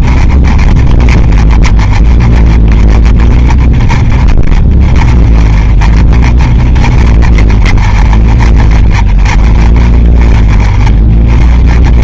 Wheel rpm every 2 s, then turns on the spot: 30, 30, 30, 30, 30, 30.
none